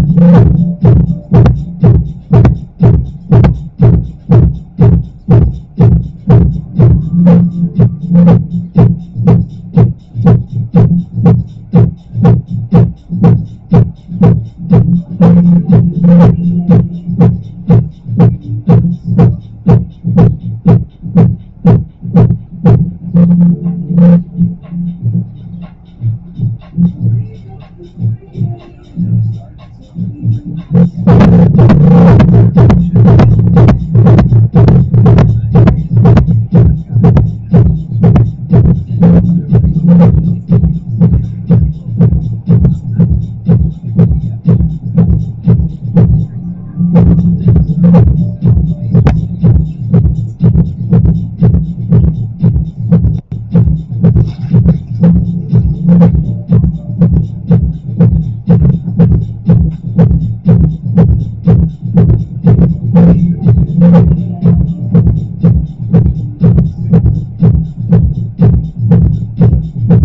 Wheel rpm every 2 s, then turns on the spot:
0, 0, 0, 0, 0, 0, 0, 0, 0, 0, 0, 0, 0, 0, 0, 0, 0, 0, 0, 0, 0, 0, 0, 0, 0, 0, 0, 0, 0, 0, 0, 0, 0, 0, 0.
none